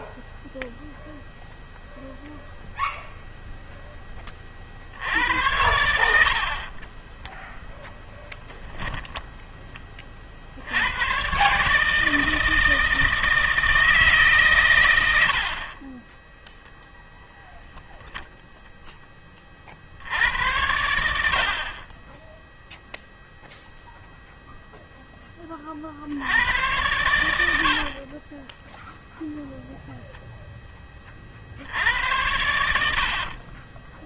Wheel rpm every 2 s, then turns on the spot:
0, 0, 50, 10, 10, 100, 160, 120, 10, 20, 80, 0, 10, 100, 0, 20, 60.
6-8 16-18 20-22 32-34